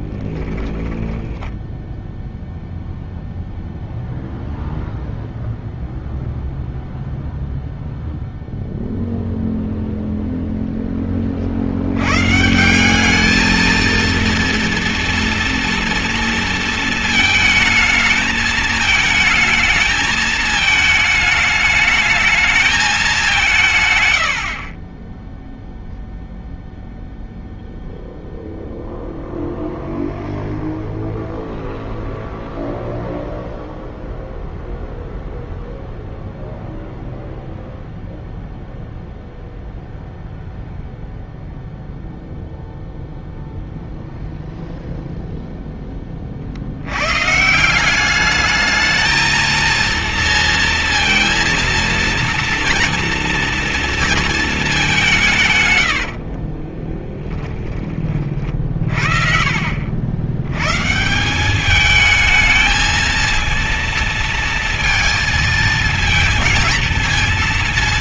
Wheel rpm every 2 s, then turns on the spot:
10, 0, 0, 0, 0, 20, 200, 230, 220, 220, 220, 200, 20, 0, 0, 0, 0, 0, 0, 0, 0, 0, 0, 120, 220, 230, 230, 170, 10, 40, 160, 220, 230, 230.
0-2 24-26 56-58